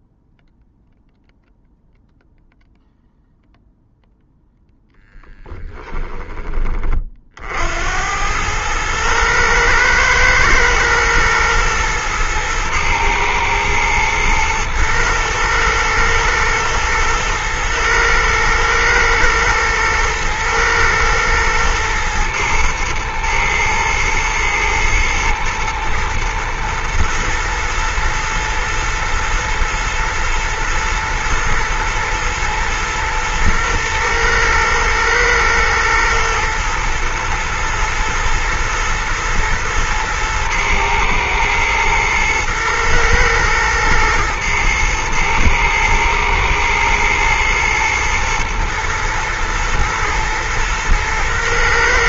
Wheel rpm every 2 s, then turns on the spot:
0, 0, 10, 50, 110, 120, 110, 120, 110, 120, 110, 110, 120, 120, 110, 110, 120, 120, 110, 110, 110, 110, 110, 120, 120, 110.
4-6